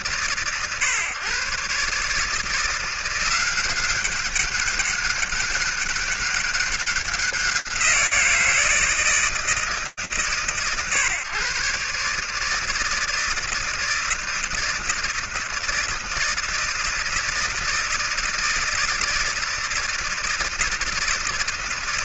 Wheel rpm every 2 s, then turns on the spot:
120, 160, 190, 200, 170, 120, 140, 160, 160, 160, 160.
none